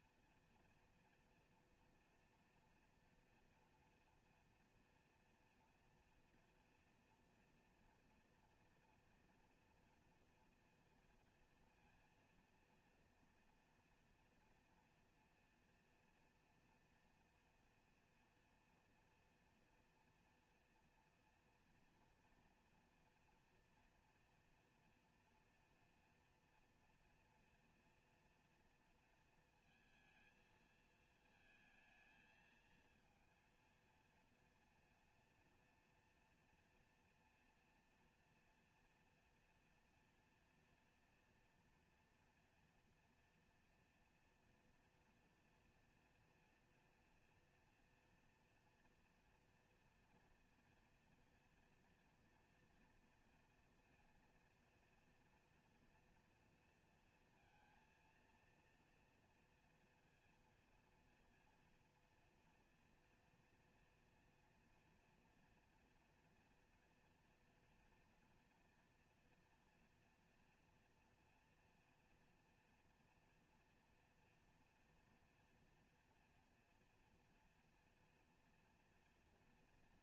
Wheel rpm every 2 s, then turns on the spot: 230, 240, 230, 230, 230, 240, 230, 240, 230, 230, 230, 230, 240, 230, 230, 220, 230, 230, 240, 230, 230, 230, 240, 240, 230, 230, 230, 230, 230, 230, 230, 230, 230, 240, 230, 230, 230, 230, 230, 230.
none